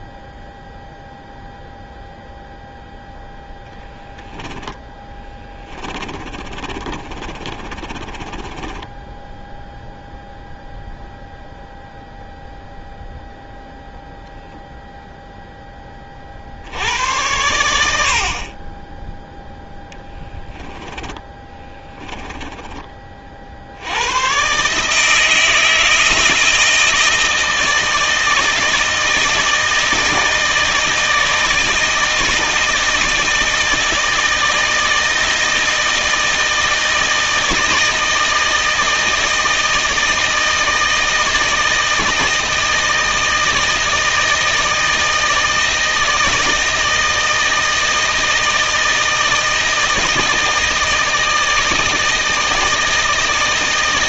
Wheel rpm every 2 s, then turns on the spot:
0, 0, 10, 30, 20, 0, 0, 0, 70, 30, 10, 20, 140, 160, 160, 160, 160, 160, 160, 160, 160, 160, 160, 160, 160, 160, 160.
4-10 20-22